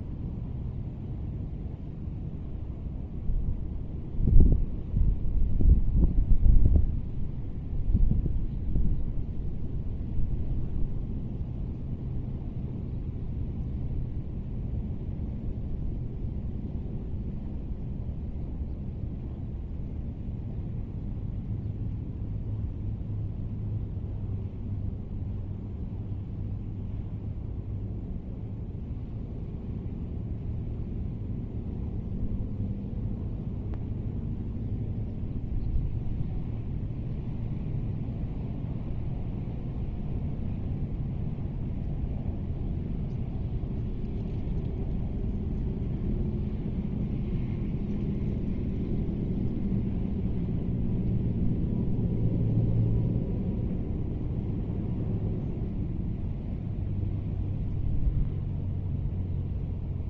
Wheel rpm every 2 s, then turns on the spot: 0, 0, 0, 0, 0, 0, 0, 0, 0, 0, 0, 0, 0, 0, 0, 0, 0, 0, 0, 0, 0, 0, 0, 0, 0, 0, 0, 0, 0, 0.
none